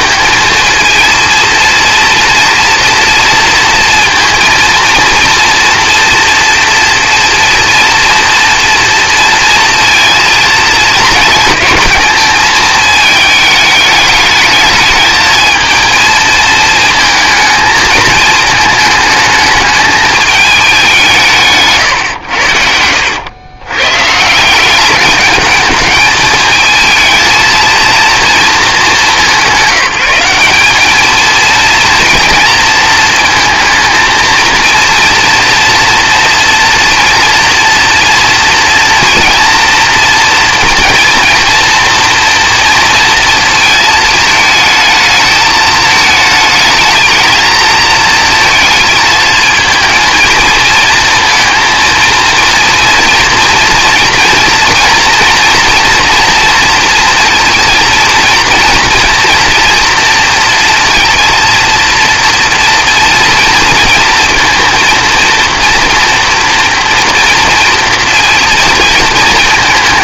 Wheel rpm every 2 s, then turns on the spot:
230, 230, 230, 230, 230, 220, 220, 210, 230, 220, 200, 90, 180, 220, 210, 200, 230, 230, 230, 230, 230, 230, 220, 220, 220, 230, 230, 240, 230, 230, 230, 230, 230, 240, 230.
none